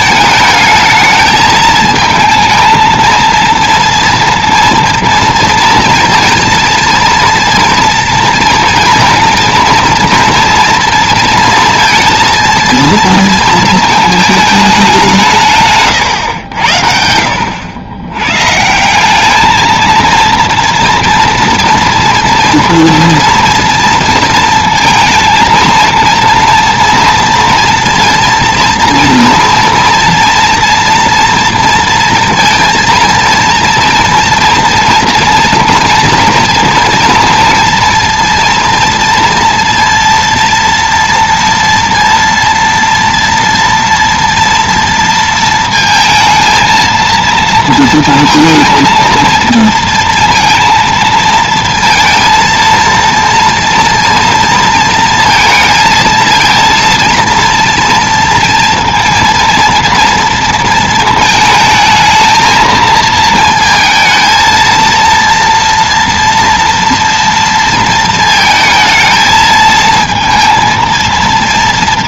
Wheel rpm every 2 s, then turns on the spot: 220, 230, 230, 230, 230, 230, 230, 210, 90, 130, 230, 230, 230, 230, 230, 230, 230, 230, 230, 230, 230, 230, 230, 230, 230, 230, 230, 230, 230, 230, 230, 220, 220, 230, 220, 230.
none